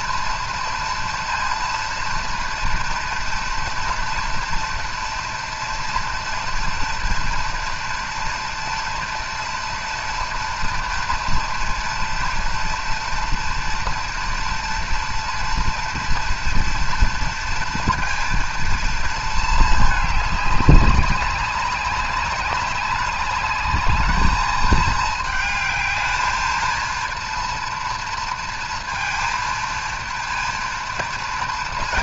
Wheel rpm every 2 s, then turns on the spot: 230, 230, 230, 230, 240, 230, 230, 230, 230, 230, 200, 190, 210, 220, 230, 230.
none